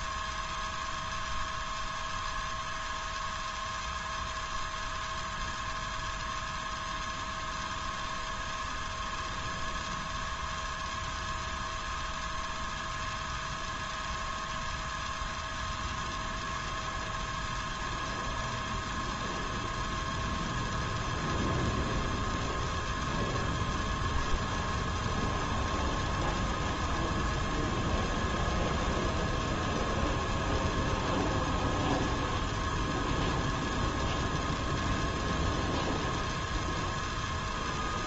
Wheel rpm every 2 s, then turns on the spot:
0, 0, 0, 0, 0, 0, 0, 0, 0, 0, 0, 0, 0, 0, 0, 0, 0, 0, 0.
none